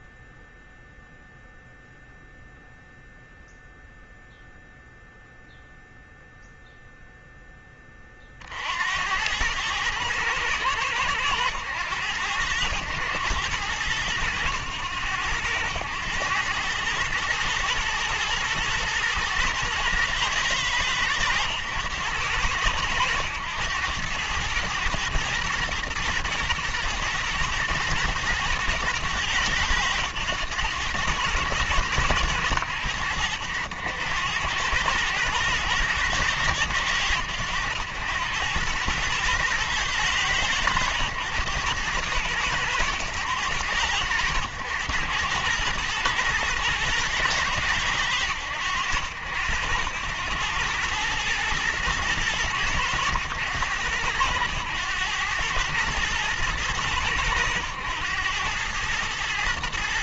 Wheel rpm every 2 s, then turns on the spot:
0, 0, 0, 0, 70, 100, 100, 100, 110, 110, 110, 100, 110, 110, 110, 100, 90, 100, 100, 110, 110, 100, 90, 110, 80, 100, 100, 100, 100, 110.
none